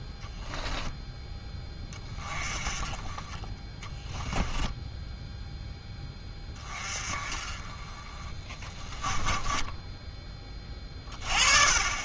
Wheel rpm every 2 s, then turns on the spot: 10, 30, 10, 20, 20, 20.
4-6